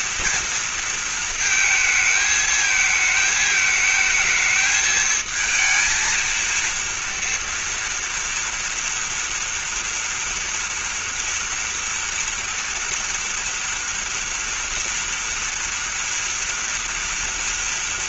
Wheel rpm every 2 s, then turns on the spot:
230, 220, 220, 230, 230, 230, 230, 230, 230.
none